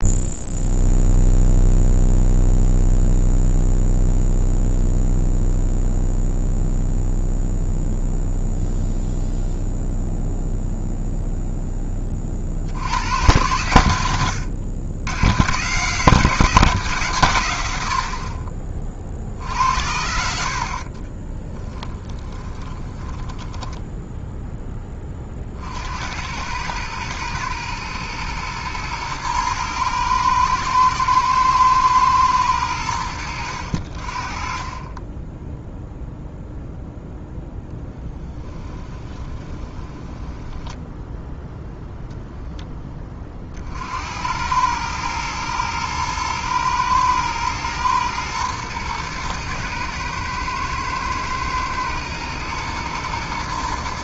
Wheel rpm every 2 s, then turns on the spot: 0, 0, 0, 0, 0, 0, 60, 100, 190, 40, 50, 20, 10, 100, 110, 110, 100, 30, 0, 10, 10, 20, 100, 110, 110, 110, 110.
22-24 38-42